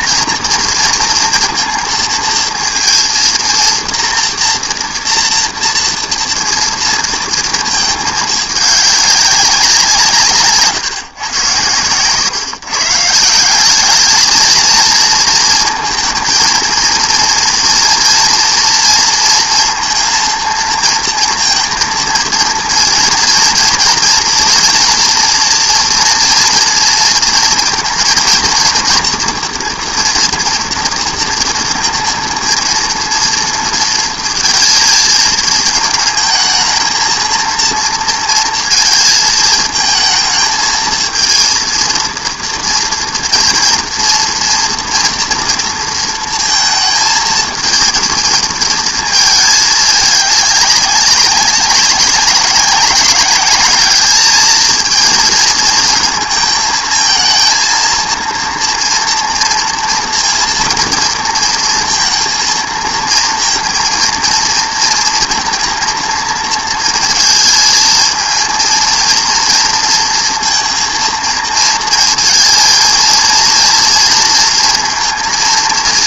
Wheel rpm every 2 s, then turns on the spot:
230, 230, 230, 230, 210, 150, 130, 210, 230, 230, 230, 230, 230, 230, 230, 240, 230, 230, 220, 230, 220, 230, 230, 230, 230, 210, 200, 220, 230, 230, 230, 230, 230, 230, 230, 230, 220, 230.
none